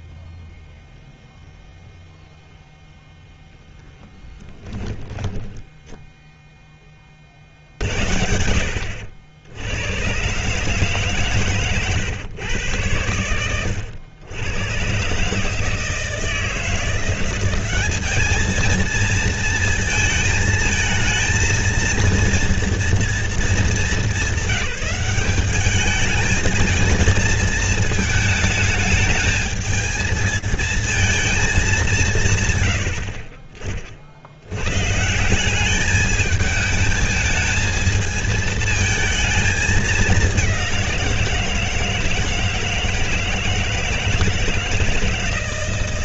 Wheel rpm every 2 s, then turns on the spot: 0, 0, 10, 10, 80, 140, 110, 110, 160, 220, 230, 230, 190, 220, 220, 220, 130, 100, 220, 220, 190, 160, 160.
4-6